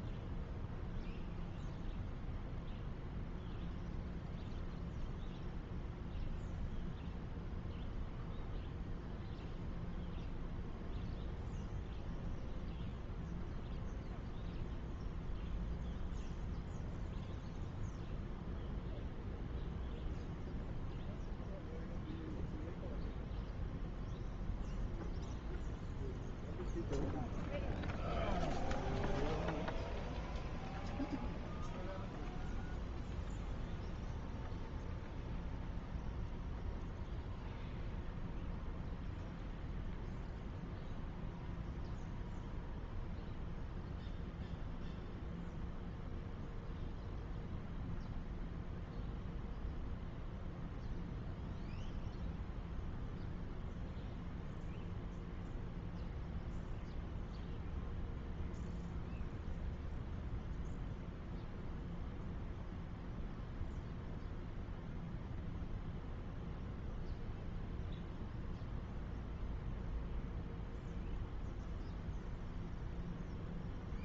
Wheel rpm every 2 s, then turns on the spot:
0, 0, 0, 0, 0, 0, 0, 0, 0, 0, 0, 0, 0, 0, 0, 0, 0, 0, 0, 0, 0, 0, 0, 0, 0, 0, 0, 0, 0, 0, 0, 0, 0, 0, 0, 0, 0.
none